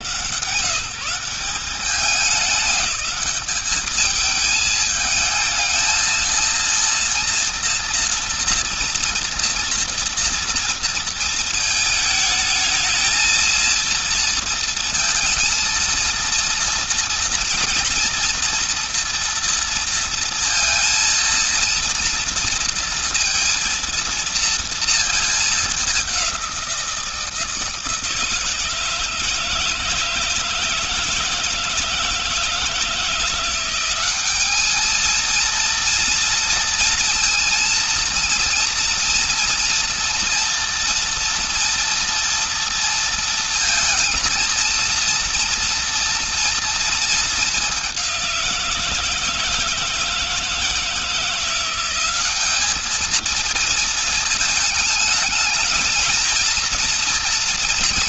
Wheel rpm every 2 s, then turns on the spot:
150, 190, 210, 220, 230, 230, 220, 230, 230, 230, 230, 230, 230, 200, 160, 160, 160, 190, 230, 230, 230, 230, 230, 230, 190, 160, 190, 220, 220.
none